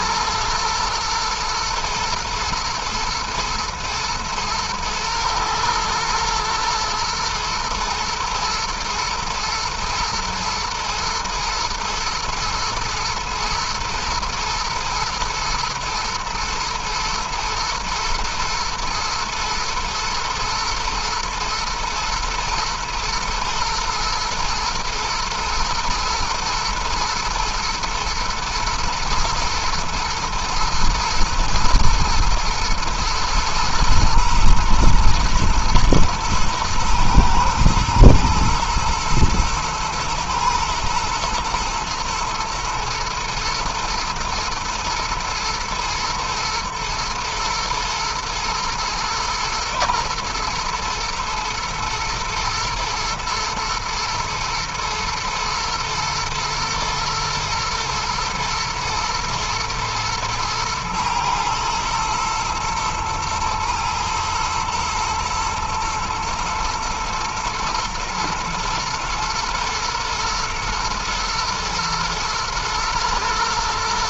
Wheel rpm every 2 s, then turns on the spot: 110, 110, 110, 120, 110, 120, 120, 120, 120, 120, 120, 120, 120, 120, 120, 120, 110, 120, 110, 120, 120, 110, 110, 120, 120, 110, 110, 110, 120, 120, 110, 110, 110, 120, 120, 120, 110.
none